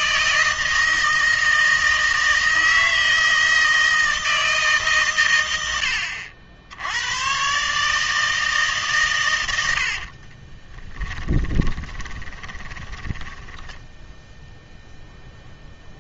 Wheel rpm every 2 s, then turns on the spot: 160, 160, 150, 80, 150, 20, 10, 0.
10-14